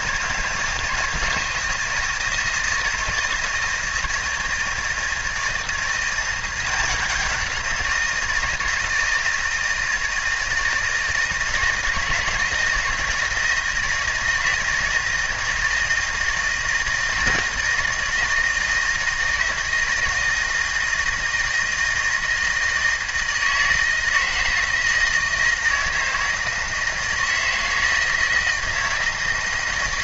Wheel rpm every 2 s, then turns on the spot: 160, 160, 160, 180, 170, 160, 160, 160, 160, 160, 160, 160, 160, 160, 160.
none